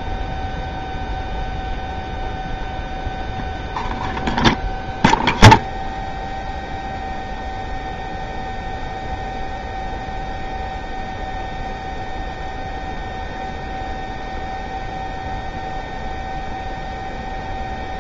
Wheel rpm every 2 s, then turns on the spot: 0, 0, 0, 0, 0, 0, 0, 0, 0.
none